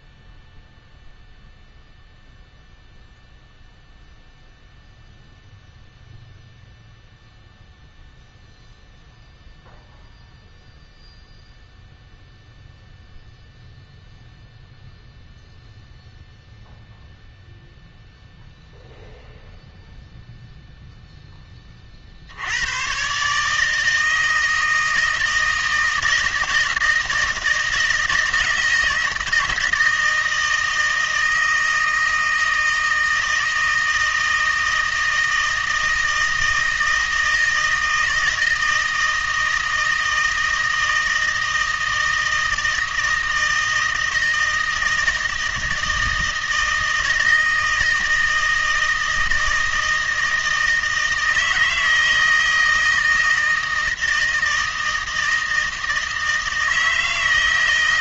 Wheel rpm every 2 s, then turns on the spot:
0, 0, 0, 0, 0, 0, 0, 0, 0, 0, 0, 110, 160, 160, 160, 160, 160, 160, 160, 160, 160, 160, 160, 160, 160, 160, 160, 160, 160.
none